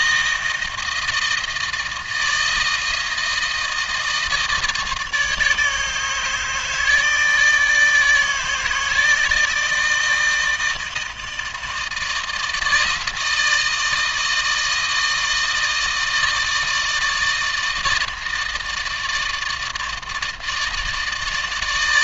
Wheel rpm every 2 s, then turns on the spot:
160, 160, 160, 150, 160, 160, 160, 160, 160, 160, 160.
none